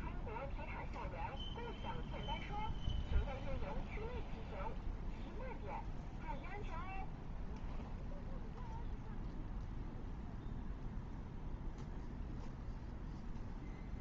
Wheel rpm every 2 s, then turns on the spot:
0, 0, 0, 0, 0, 0, 0.
none